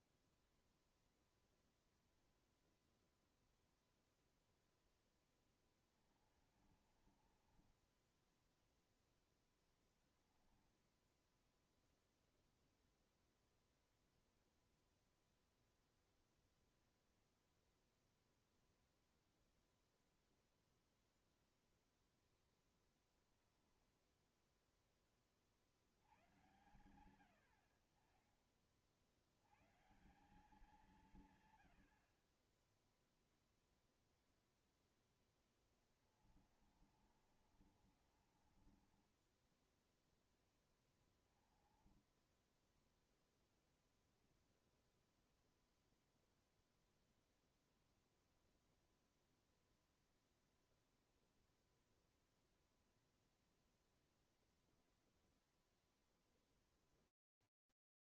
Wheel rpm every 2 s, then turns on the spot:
10, 0, 0, 30, 20, 10, 0, 0, 0, 0, 0, 0, 0, 80, 50, 160, 80, 0, 20, 40, 10, 10, 0, 0, 0, 0, 0, 0, 0.
0-2 6-12 36-40 42-44